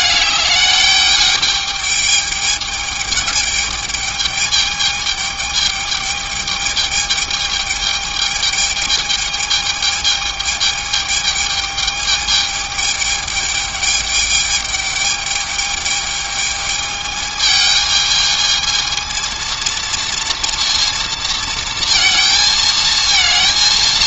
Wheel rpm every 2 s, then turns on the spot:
210, 210, 210, 210, 210, 210, 210, 210, 220, 220, 230, 220.
none